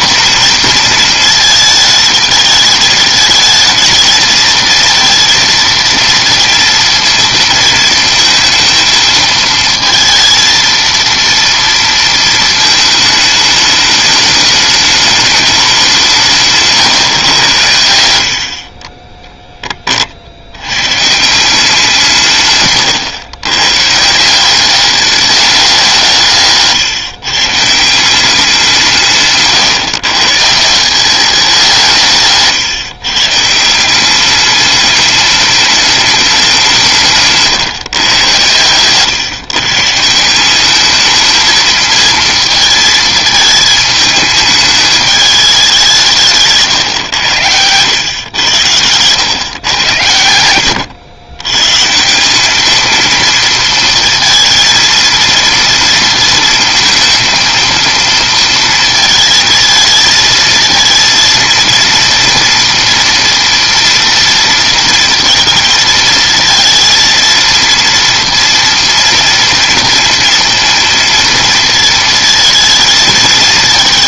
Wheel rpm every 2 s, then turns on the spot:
250, 220, 220, 230, 230, 230, 220, 210, 150, 50, 90, 140, 190, 150, 180, 150, 140, 200, 190, 120, 190, 230, 210, 150, 100, 90, 200, 230, 220, 230, 220, 230, 230, 220, 230, 230, 230.
22-24 26-28